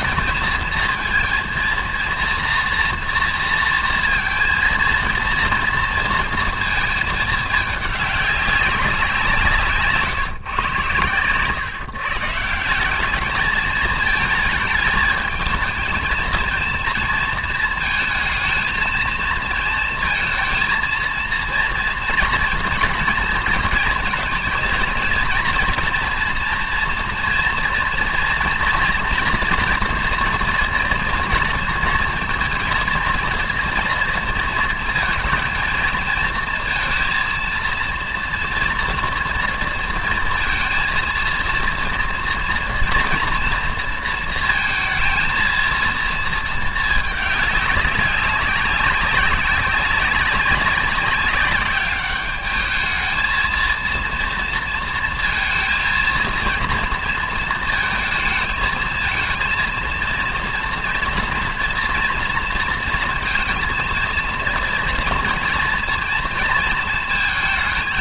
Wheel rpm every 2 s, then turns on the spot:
220, 230, 230, 230, 200, 130, 160, 220, 220, 220, 230, 230, 230, 230, 230, 230, 230, 230, 220, 230, 230, 230, 230, 220, 190, 190, 210, 230, 230, 220, 230, 230, 230, 230.
none